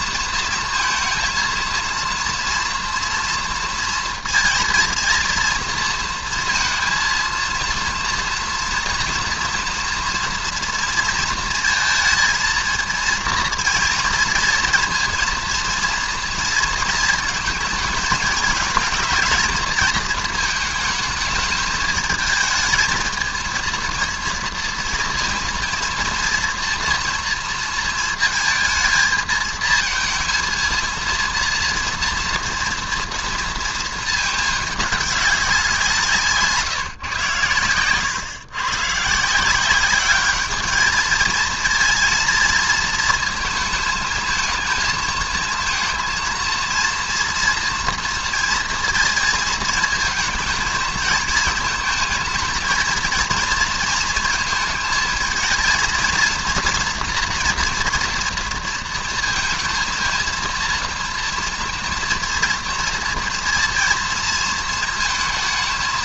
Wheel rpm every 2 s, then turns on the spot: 230, 230, 230, 230, 240, 230, 230, 230, 230, 220, 220, 220, 230, 230, 220, 220, 230, 210, 150, 120, 210, 230, 220, 230, 230, 220, 220, 220, 230, 230, 230, 230, 220.
none